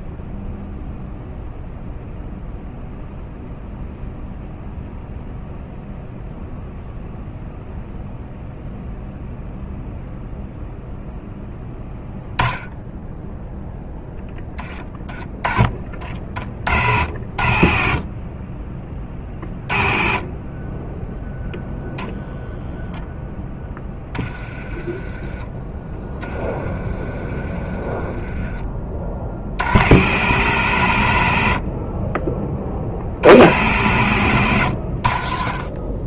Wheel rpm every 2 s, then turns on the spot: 0, 0, 0, 0, 0, 0, 10, 20, 60, 20, 20, 0, 20, 20, 30, 120, 40, 90.
none